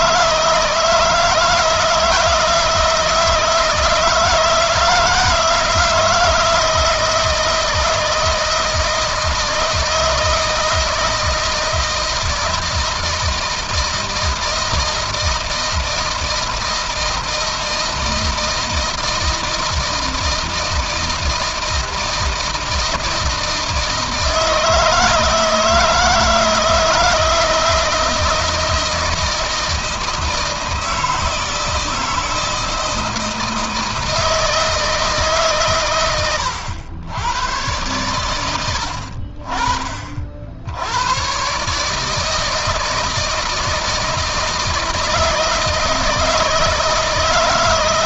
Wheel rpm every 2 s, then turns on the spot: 160, 160, 160, 160, 160, 160, 160, 160, 160, 160, 160, 160, 160, 160, 160, 160, 160, 160, 90, 80, 100, 160, 160, 160.
none